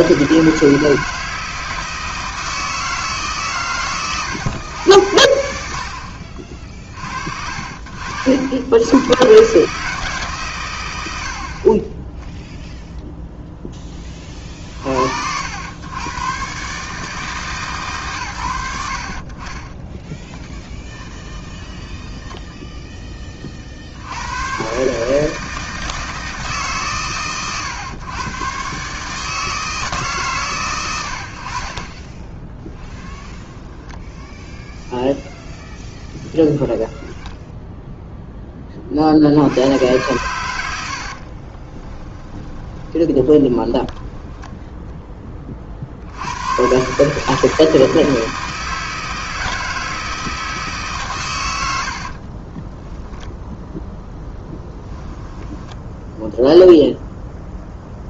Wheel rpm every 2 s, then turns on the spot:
160, 160, 90, 50, 100, 100, 0, 60, 140, 80, 10, 10, 140, 140, 140, 100, 10, 0, 0, 40, 70, 20, 10, 140, 160, 150, 20, 10, 0.
20-22 32-34 40-44 52-56